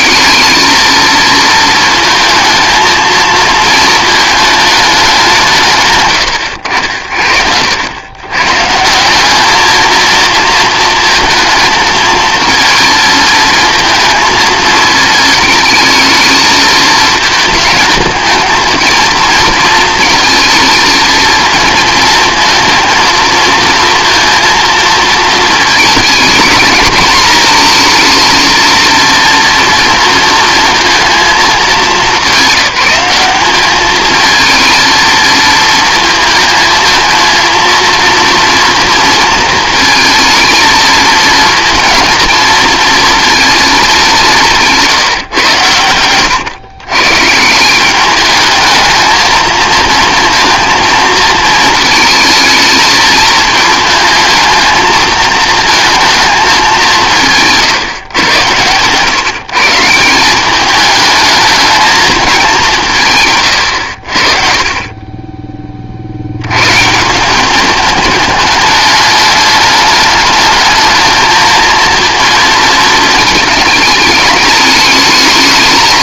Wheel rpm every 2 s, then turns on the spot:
220, 220, 220, 90, 140, 230, 220, 220, 220, 230, 230, 230, 230, 220, 230, 230, 200, 230, 230, 230, 220, 230, 170, 120, 210, 220, 230, 220, 200, 110, 200, 180, 30, 110, 210, 220, 220, 210.
none